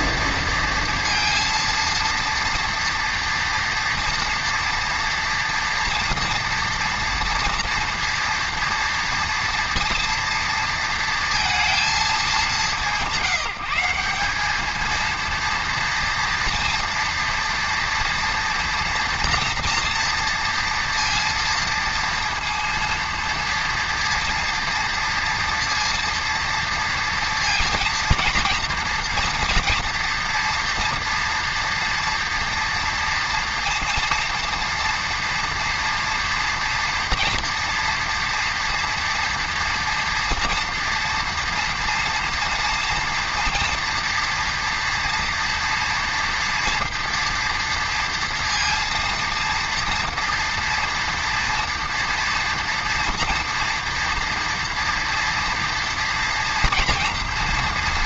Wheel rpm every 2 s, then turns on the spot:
230, 230, 240, 230, 230, 230, 200, 210, 230, 230, 230, 230, 230, 230, 230, 230, 230, 230, 230, 230, 230, 230, 230, 230, 230, 230, 230, 230, 240.
none